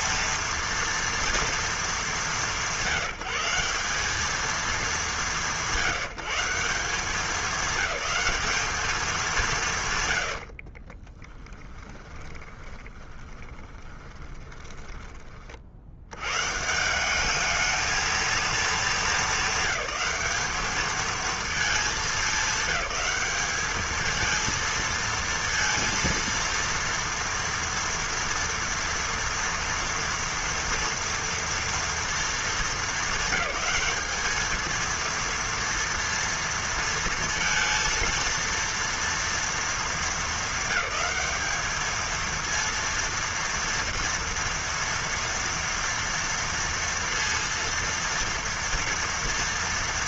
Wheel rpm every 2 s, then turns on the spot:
230, 200, 190, 170, 200, 80, 20, 10, 120, 220, 210, 200, 220, 230, 230, 230, 230, 220, 230, 230, 210, 230, 230, 230, 230.
10-16